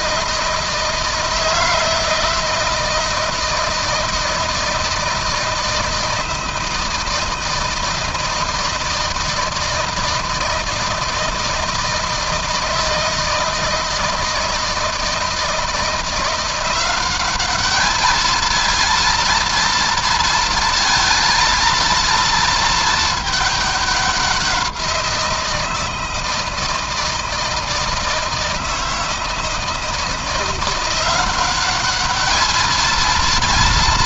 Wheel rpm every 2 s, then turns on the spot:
160, 160, 160, 160, 160, 160, 160, 160, 180, 220, 230, 220, 180, 160, 160, 180, 220.
none